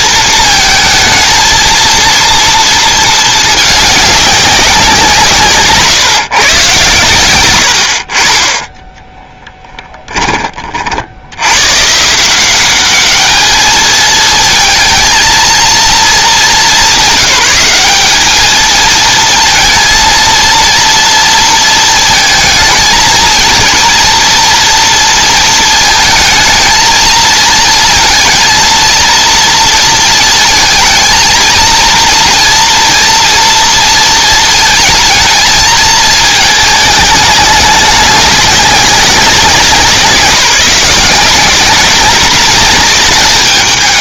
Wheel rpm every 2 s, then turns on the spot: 220, 230, 190, 130, 20, 50, 200, 230, 190, 220, 230, 220, 230, 230, 230, 220, 230, 220, 210, 190, 180, 190.
none